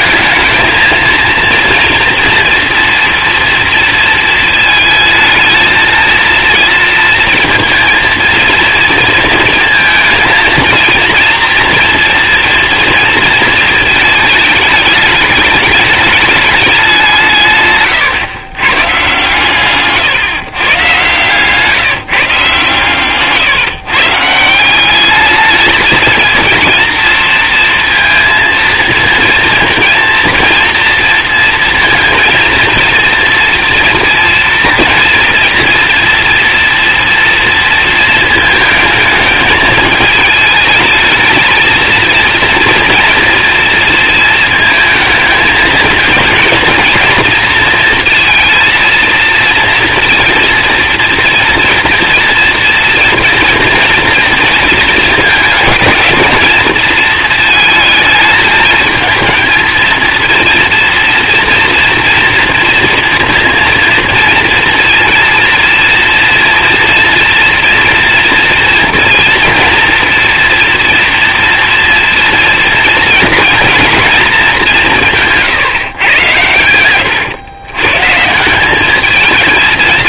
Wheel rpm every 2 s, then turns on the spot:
230, 230, 220, 230, 230, 230, 230, 210, 180, 130, 130, 130, 200, 230, 230, 230, 230, 230, 230, 220, 220, 230, 220, 230, 230, 230, 230, 220, 220, 220, 230, 240, 230, 240, 230, 230, 230, 160, 110, 220.
none